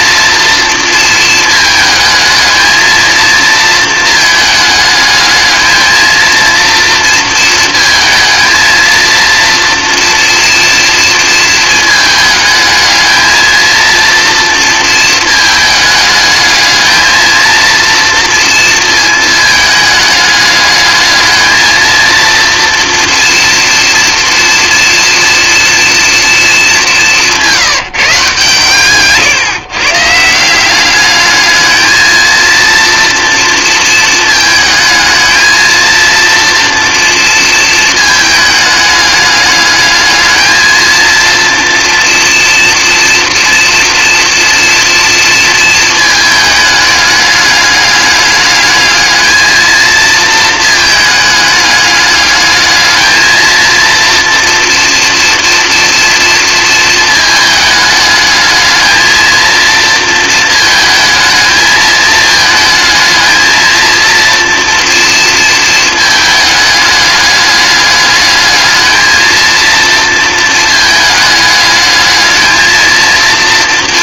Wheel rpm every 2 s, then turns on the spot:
220, 230, 220, 230, 230, 220, 220, 220, 230, 210, 220, 230, 230, 170, 140, 220, 230, 220, 220, 210, 230, 230, 230, 210, 220, 210, 230, 230, 210, 230, 220, 230, 230, 210, 230, 220, 230.
none